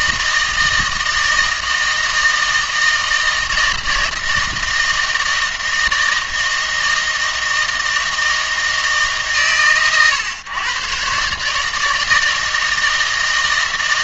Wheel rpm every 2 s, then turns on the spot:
160, 160, 160, 160, 150, 130, 160.
none